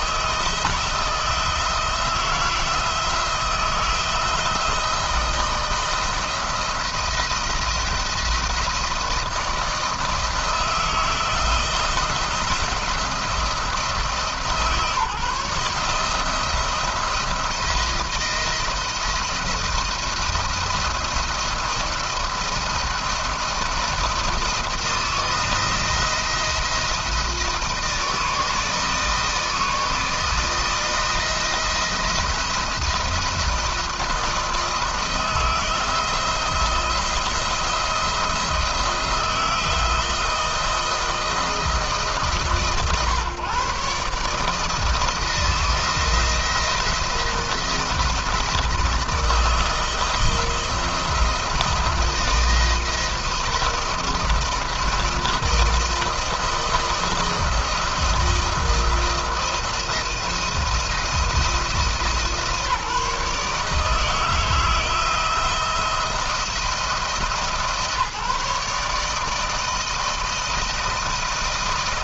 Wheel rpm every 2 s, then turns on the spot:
160, 160, 170, 170, 170, 170, 170, 150, 160, 170, 170, 170, 170, 160, 160, 160, 170, 160, 170, 170, 160, 140, 150, 170, 170, 170, 170, 170, 170, 170, 170, 160, 160, 170, 150, 160.
none